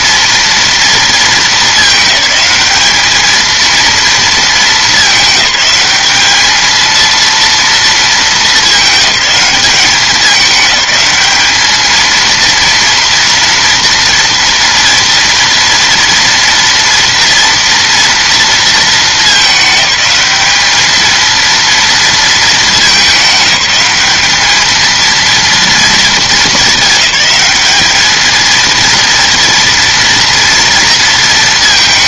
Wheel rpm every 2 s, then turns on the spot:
230, 210, 220, 220, 200, 210, 230, 230, 230, 220, 210, 210, 220, 200, 230, 230.
none